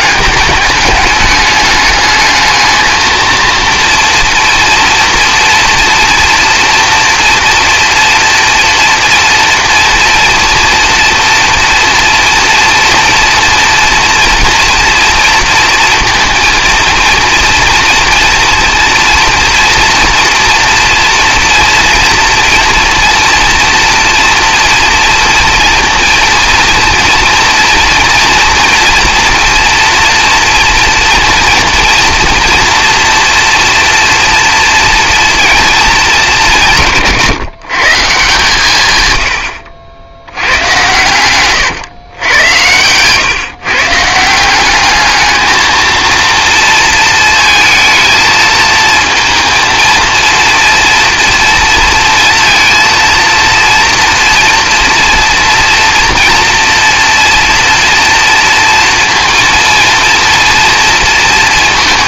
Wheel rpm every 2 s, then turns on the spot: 210, 220, 230, 230, 230, 230, 230, 230, 230, 230, 240, 240, 240, 230, 230, 230, 230, 230, 170, 120, 110, 110, 200, 230, 220, 230, 230, 240, 230, 230, 230.
none